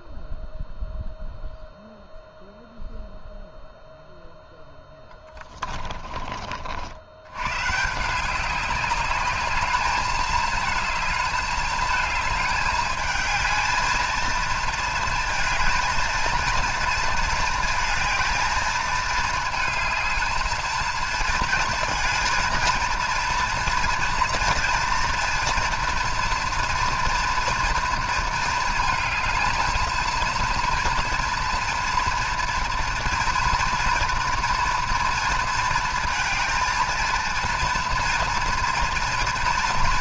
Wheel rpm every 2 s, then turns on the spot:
0, 0, 10, 60, 200, 220, 210, 230, 230, 220, 220, 230, 240, 230, 220, 230, 240, 240, 230, 230.
none